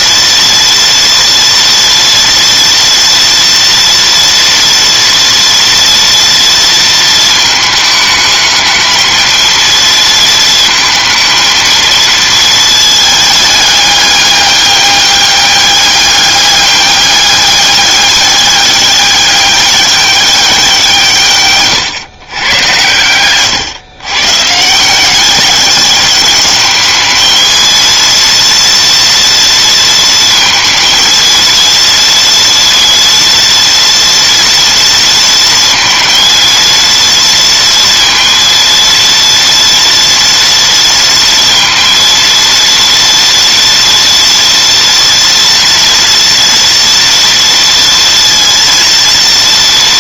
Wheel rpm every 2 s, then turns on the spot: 230, 230, 240, 230, 220, 220, 220, 200, 200, 200, 170, 110, 180, 220, 230, 230, 230, 230, 230, 230, 230, 230, 230, 230, 230.
none